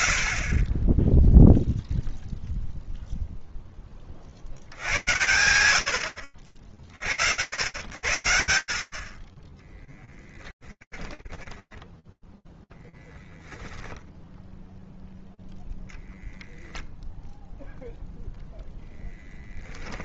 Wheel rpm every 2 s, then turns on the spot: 50, 0, 90, 60, 30, 20, 10, 0, 0, 10.
10-12